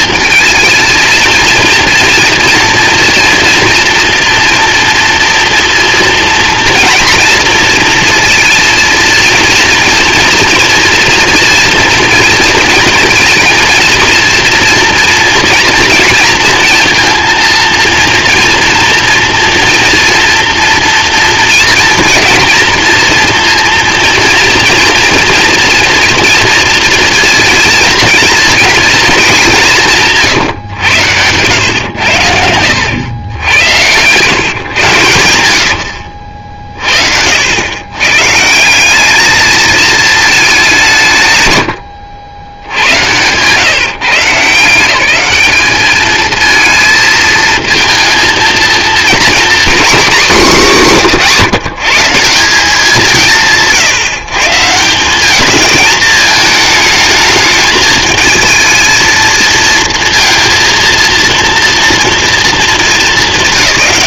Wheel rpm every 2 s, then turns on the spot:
230, 230, 240, 230, 230, 230, 230, 230, 230, 230, 230, 230, 230, 230, 230, 140, 100, 130, 40, 180, 200, 80, 170, 220, 230, 210, 190, 160, 220, 220, 230, 220.
34-36